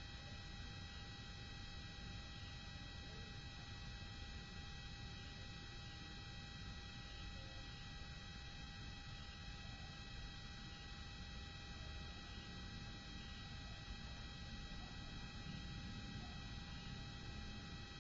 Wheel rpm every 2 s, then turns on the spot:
0, 0, 0, 0, 0, 0, 0, 0, 0.
none